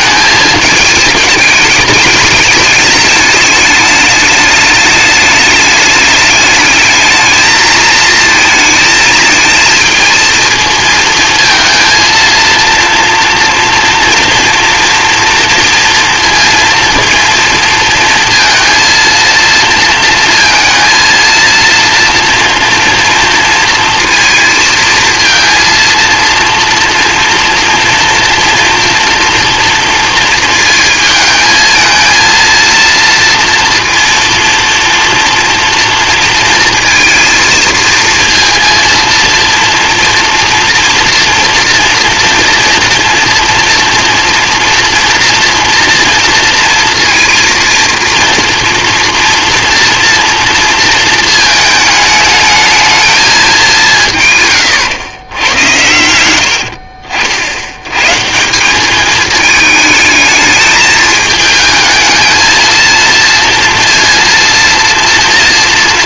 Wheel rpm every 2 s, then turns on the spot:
220, 210, 210, 210, 220, 230, 230, 230, 230, 230, 230, 230, 230, 230, 240, 230, 230, 230, 230, 230, 230, 230, 230, 230, 240, 230, 220, 120, 70, 180, 220, 220, 230.
54-58